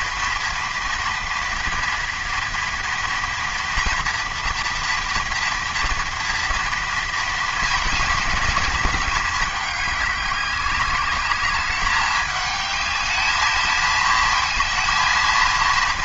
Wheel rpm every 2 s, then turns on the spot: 230, 230, 230, 230, 210, 200, 210, 230.
none